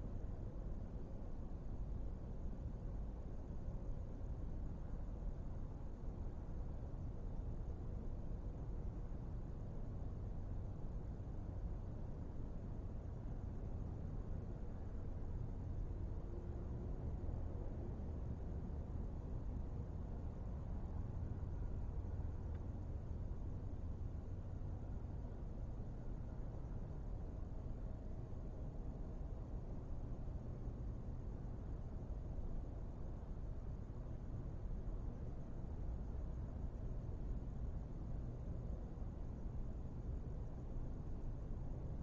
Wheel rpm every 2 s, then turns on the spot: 0, 0, 0, 0, 0, 0, 0, 0, 0, 0, 0, 0, 0, 0, 0, 0, 0, 0, 0, 0, 0.
none